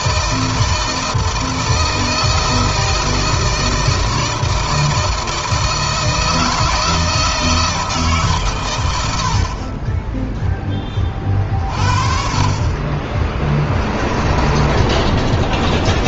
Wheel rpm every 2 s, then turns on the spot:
160, 160, 160, 170, 120, 30, 30, 20.
12-16